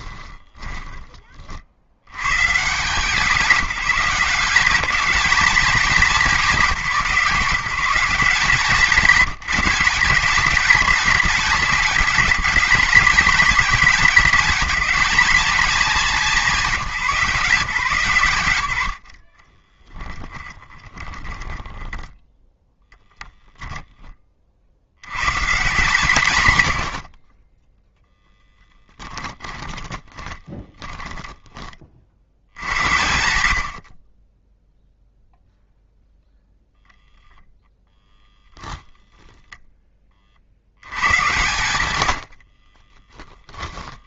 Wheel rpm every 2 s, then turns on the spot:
20, 160, 190, 180, 170, 210, 210, 220, 190, 110, 20, 10, 50, 90, 10, 20, 90, 0, 0, 20, 90, 50.
0-2 20-22 28-32 42-44